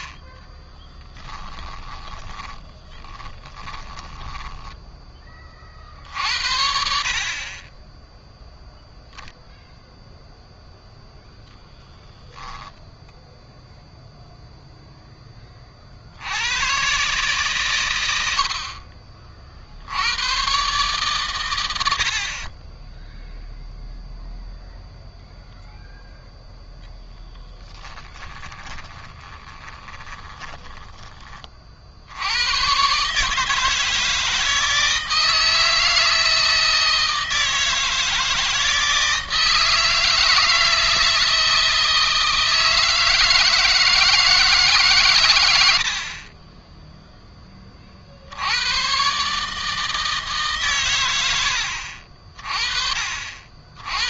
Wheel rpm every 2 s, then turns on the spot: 10, 20, 10, 60, 0, 0, 0, 0, 110, 50, 130, 10, 0, 10, 20, 20, 130, 160, 160, 160, 160, 160, 130, 10, 120, 120, 40.
0-4 28-30